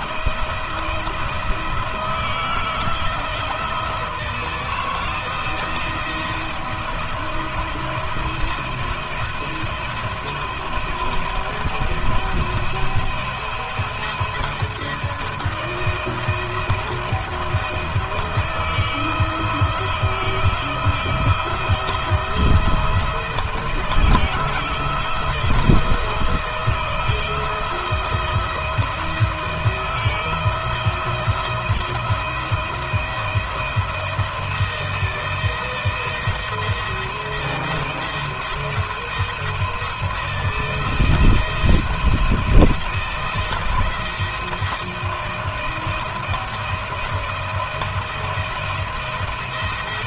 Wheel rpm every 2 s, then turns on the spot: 170, 160, 160, 170, 170, 170, 170, 170, 170, 160, 170, 170, 160, 160, 170, 160, 170, 170, 170, 170, 170, 160, 160, 170, 170.
none